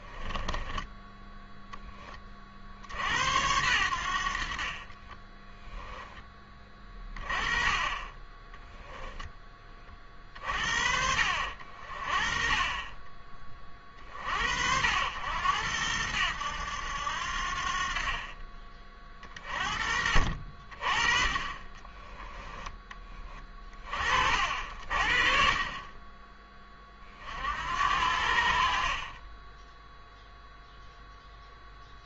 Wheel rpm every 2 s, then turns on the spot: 10, 50, 40, 20, 10, 50, 30, 70, 90, 30, 40, 10, 50, 20, 40, 0.
4-6